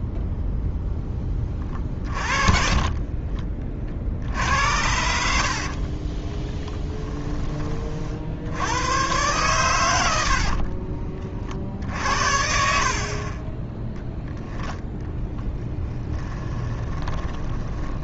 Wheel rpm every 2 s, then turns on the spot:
0, 30, 70, 10, 90, 40, 50, 10, 20.
2-4 10-14 16-18